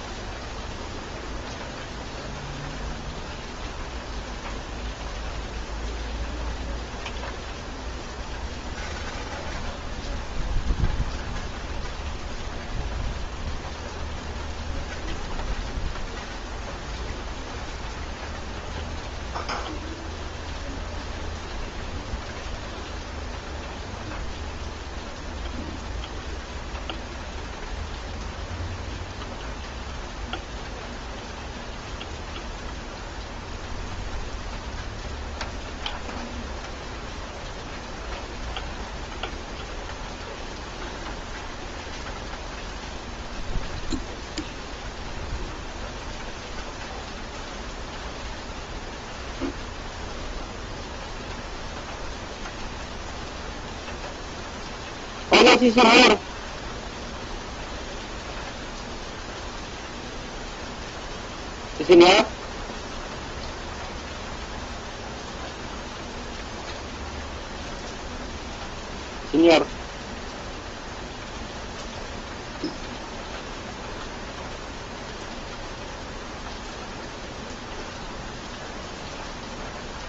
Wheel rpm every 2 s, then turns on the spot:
0, 0, 0, 0, 0, 0, 0, 0, 0, 0, 0, 0, 0, 0, 0, 0, 0, 0, 0, 0, 0, 0, 0, 0, 0, 0, 0, 0, 0, 0, 0, 0, 0, 0, 0, 0, 0, 0, 0, 0.
none